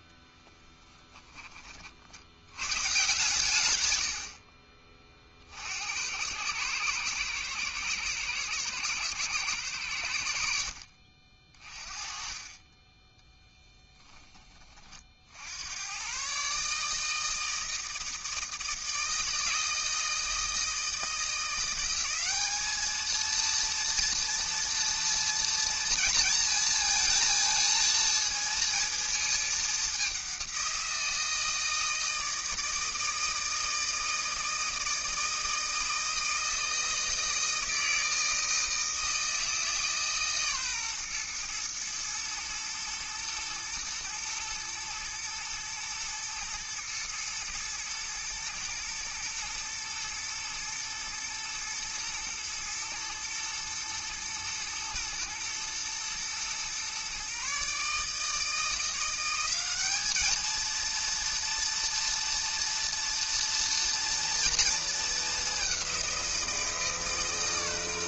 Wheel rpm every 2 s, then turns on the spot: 10, 110, 40, 100, 110, 70, 30, 20, 140, 160, 160, 210, 230, 230, 230, 190, 160, 160, 160, 160, 140, 110, 110, 110, 120, 110, 110, 110, 120, 160, 220, 230, 230, 170.
0-2 12-14